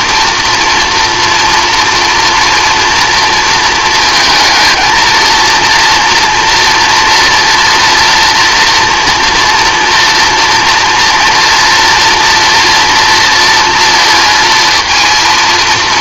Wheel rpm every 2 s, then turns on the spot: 230, 230, 230, 230, 230, 240, 230, 230.
none